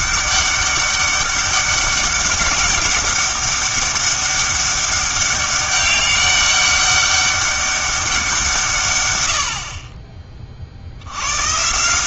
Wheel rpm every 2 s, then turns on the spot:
200, 200, 200, 200, 150, 70.
none